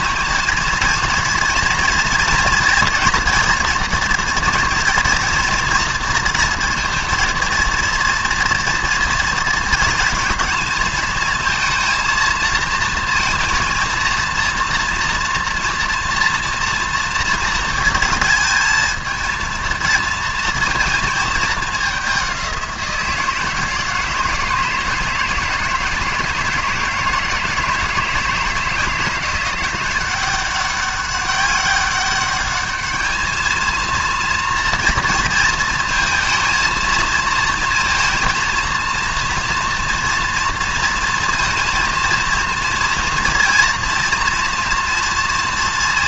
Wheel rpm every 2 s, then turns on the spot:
230, 230, 230, 230, 230, 220, 230, 230, 230, 220, 230, 180, 160, 160, 160, 200, 210, 230, 230, 230, 230, 230, 240.
none